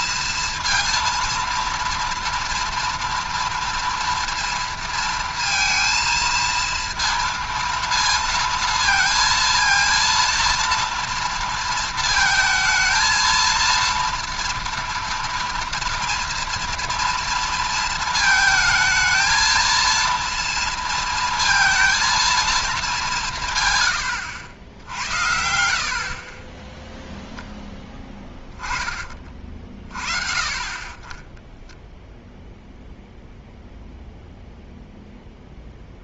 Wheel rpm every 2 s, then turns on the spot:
230, 230, 230, 230, 230, 230, 220, 230, 230, 220, 230, 230, 80, 10, 10, 40, 0, 0.
none